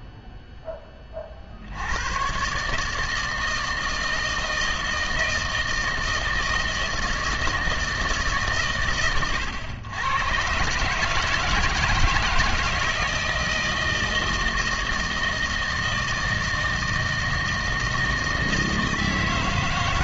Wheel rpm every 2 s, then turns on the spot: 10, 130, 160, 160, 130, 130, 160, 160, 160, 160.
none